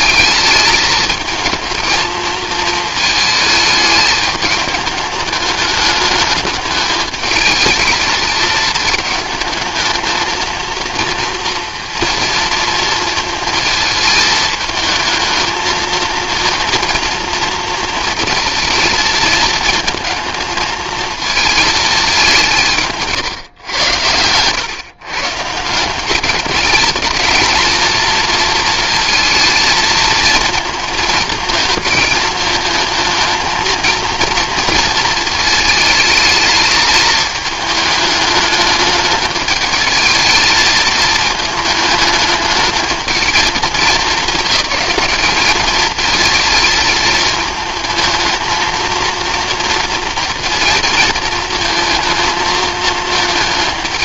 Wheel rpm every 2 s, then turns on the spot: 210, 220, 210, 210, 210, 230, 230, 220, 230, 220, 220, 160, 130, 210, 230, 220, 220, 230, 220, 210, 220, 220, 200, 220, 230, 230, 220.
none